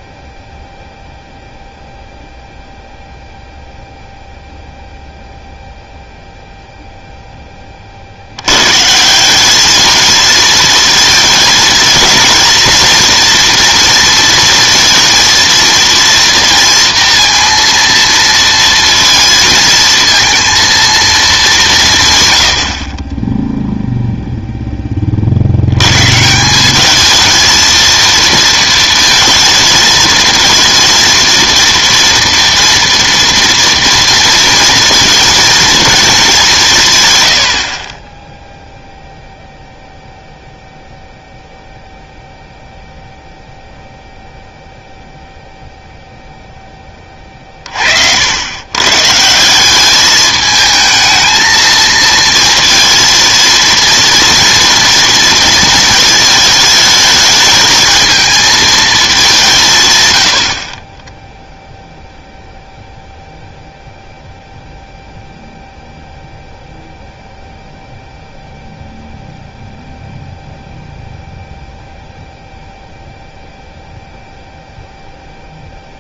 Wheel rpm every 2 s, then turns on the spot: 0, 0, 0, 0, 120, 230, 230, 230, 230, 230, 230, 90, 10, 190, 230, 220, 230, 230, 180, 0, 0, 0, 0, 10, 110, 220, 230, 230, 220, 220, 40, 0, 0, 0, 0, 0, 0, 0.
none